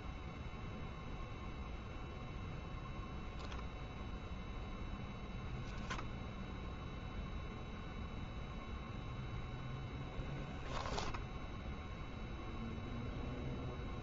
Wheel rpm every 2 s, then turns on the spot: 0, 0, 0, 0, 0, 0, 0.
none